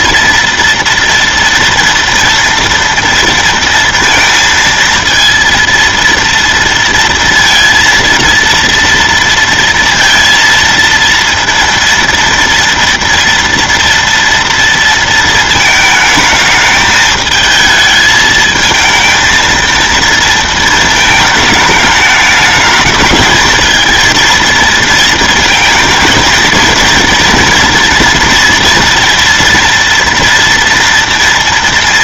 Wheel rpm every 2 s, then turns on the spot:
230, 230, 230, 230, 230, 230, 230, 230, 220, 220, 230, 210, 230, 230, 230, 230.
none